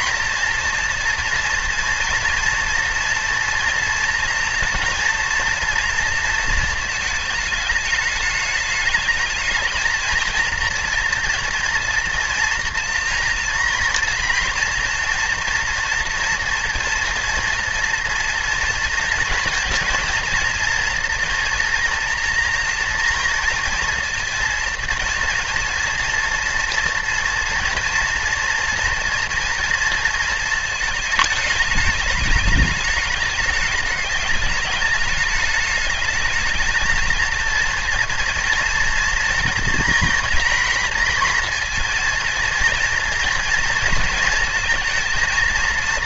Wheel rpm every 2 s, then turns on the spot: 230, 230, 230, 230, 210, 230, 240, 230, 230, 230, 230, 230, 230, 240, 230, 220, 210, 210, 220, 230, 240, 230, 230.
none